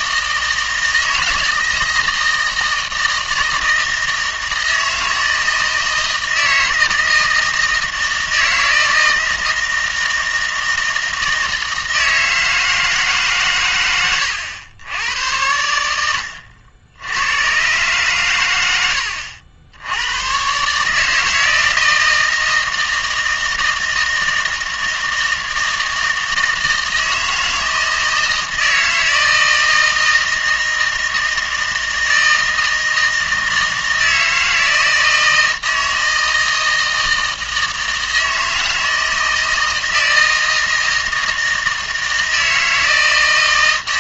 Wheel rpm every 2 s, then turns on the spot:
160, 160, 160, 160, 160, 160, 160, 100, 80, 100, 140, 160, 160, 160, 160, 160, 160, 160, 160, 160, 160, 160.
none